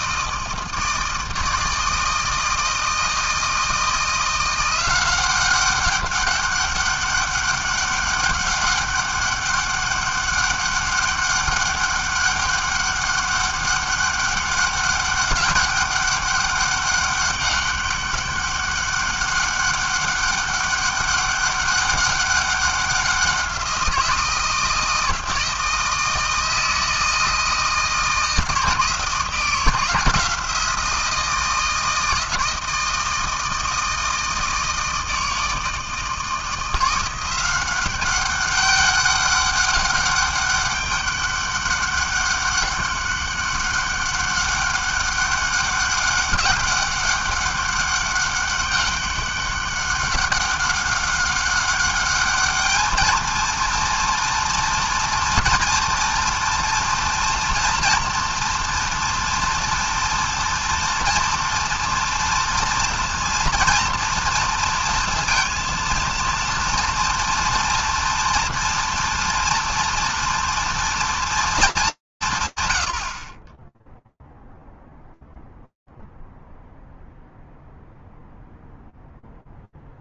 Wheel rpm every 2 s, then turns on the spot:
160, 160, 180, 200, 200, 200, 200, 190, 200, 200, 200, 190, 160, 160, 170, 170, 160, 160, 180, 200, 200, 200, 200, 200, 190, 190, 230, 230, 230, 230, 230, 230, 230, 240, 230, 230, 30, 0, 0, 0.
none